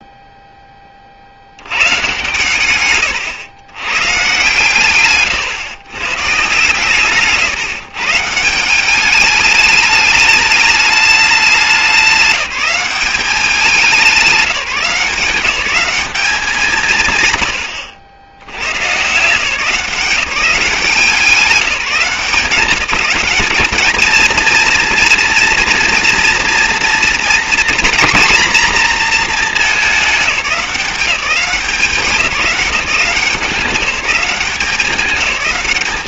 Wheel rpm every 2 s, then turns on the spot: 10, 120, 130, 130, 170, 210, 190, 180, 180, 90, 180, 180, 220, 230, 240, 190, 190, 190.
none